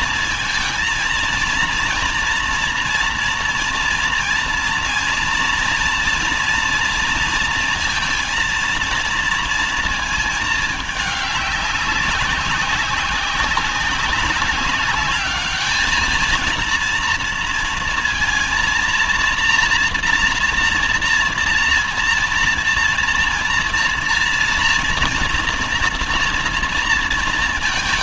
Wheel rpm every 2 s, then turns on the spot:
230, 240, 230, 240, 230, 210, 190, 190, 230, 230, 230, 230, 230, 230.
none